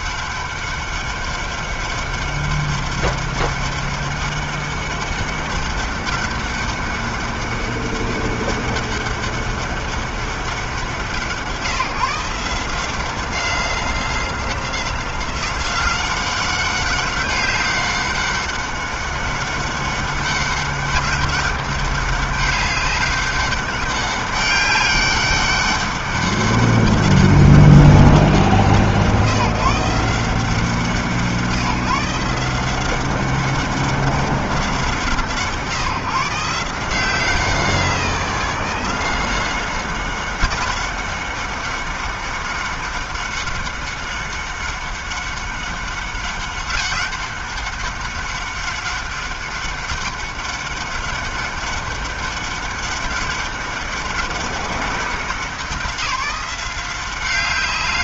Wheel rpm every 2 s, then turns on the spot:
200, 200, 200, 200, 200, 160, 190, 190, 190, 190, 200, 200, 200, 190, 160, 160, 190, 140, 180, 190, 200, 200, 200, 200, 200, 200, 200, 180, 190.
none